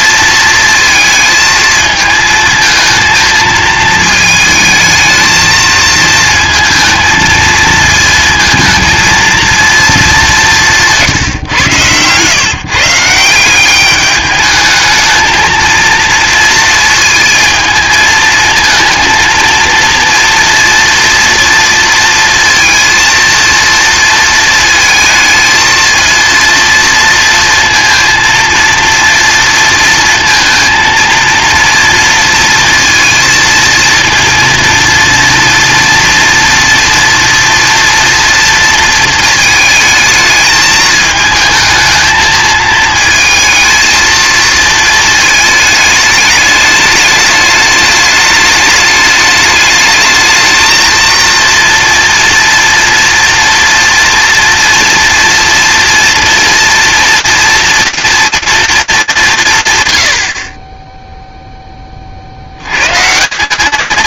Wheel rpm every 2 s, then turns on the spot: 230, 220, 220, 220, 230, 170, 140, 210, 230, 220, 230, 230, 230, 230, 230, 230, 230, 230, 240, 230, 220, 220, 230, 210, 210, 230, 230, 230, 240, 210, 10, 110.
none